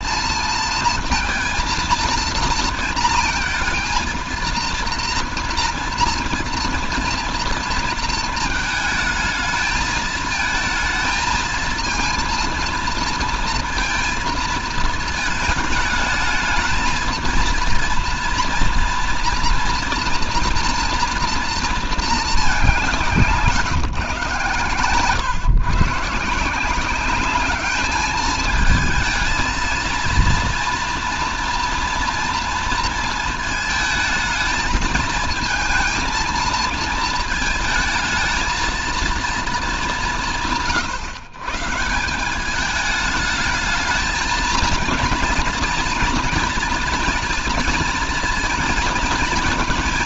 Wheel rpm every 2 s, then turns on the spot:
230, 230, 230, 230, 220, 220, 230, 220, 220, 230, 230, 180, 130, 180, 220, 240, 230, 220, 220, 220, 130, 200, 220, 230, 230.
none